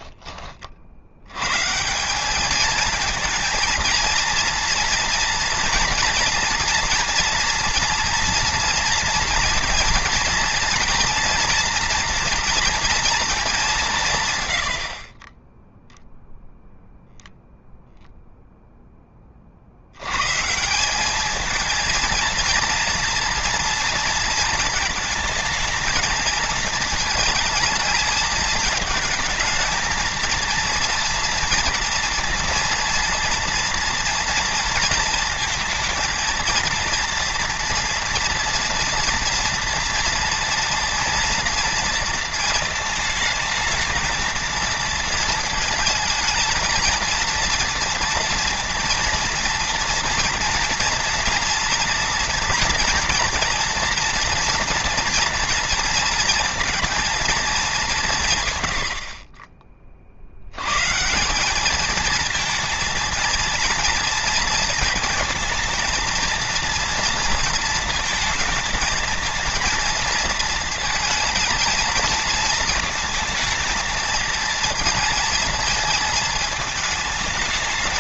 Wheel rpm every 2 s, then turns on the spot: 60, 220, 230, 240, 230, 230, 240, 80, 0, 0, 180, 230, 230, 220, 220, 230, 230, 230, 230, 230, 230, 220, 220, 220, 230, 230, 230, 230, 230, 90, 140, 220, 230, 230, 220, 220, 230, 230, 220.
none